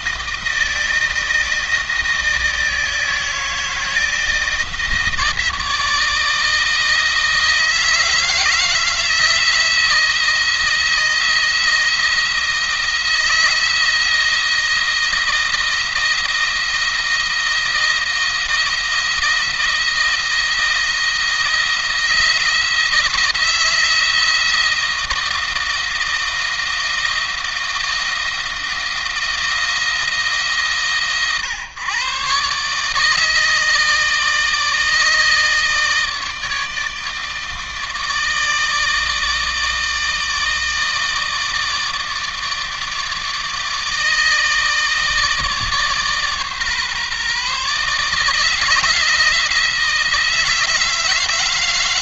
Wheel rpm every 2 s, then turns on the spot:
160, 160, 160, 160, 160, 160, 160, 170, 160, 160, 160, 160, 160, 160, 160, 140, 140, 160, 160, 160, 160, 160, 160, 140, 160, 160.
none